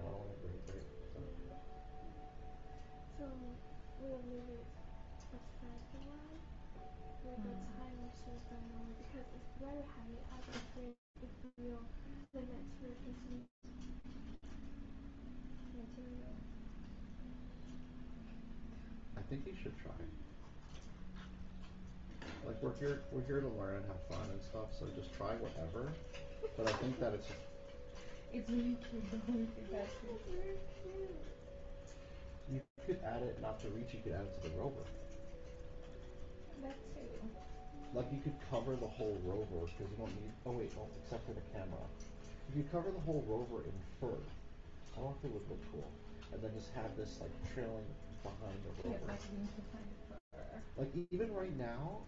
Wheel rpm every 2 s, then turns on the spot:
0, 0, 0, 0, 0, 0, 0, 0, 0, 0, 0, 0, 0, 0, 0, 0, 0, 0, 0, 0, 0, 0, 0, 0, 0, 0.
none